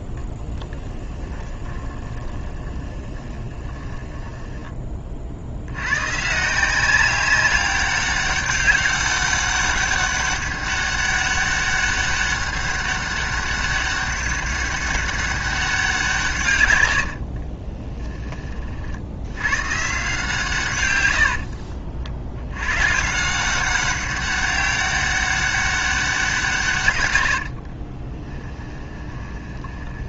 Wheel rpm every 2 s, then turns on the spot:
10, 20, 20, 180, 200, 200, 200, 200, 90, 60, 110, 140, 200, 130, 20.
0-4 16-18 28-30